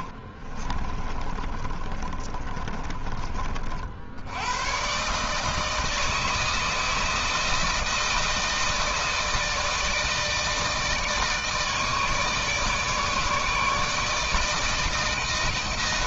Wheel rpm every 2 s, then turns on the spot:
30, 50, 150, 160, 160, 160, 150, 160.
0-2